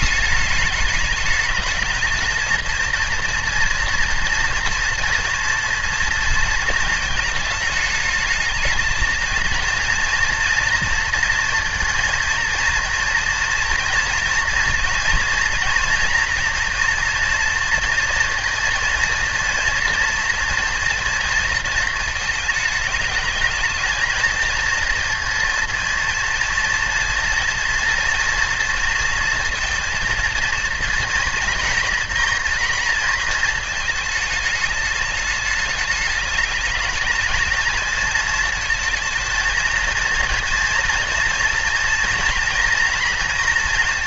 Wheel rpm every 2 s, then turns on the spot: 210, 230, 230, 220, 220, 230, 230, 230, 240, 230, 230, 210, 230, 230, 230, 230, 230, 210, 220, 220, 240, 240.
none